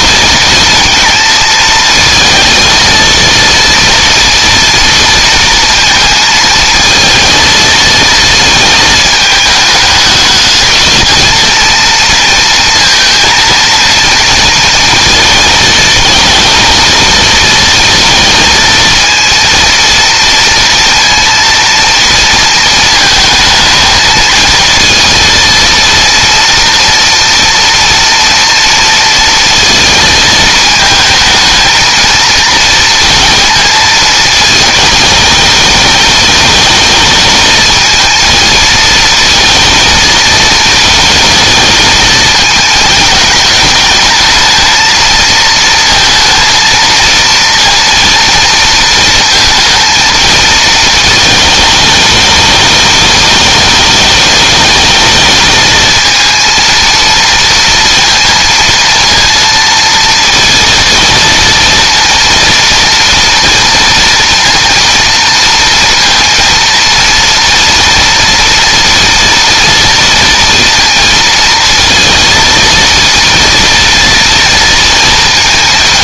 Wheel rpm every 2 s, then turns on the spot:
230, 230, 230, 230, 220, 220, 230, 230, 220, 230, 230, 230, 230, 230, 230, 220, 230, 210, 220, 220, 220, 220, 220, 230, 230, 220, 210, 220, 230, 230, 230, 230, 230, 230, 230, 230, 230, 230.
none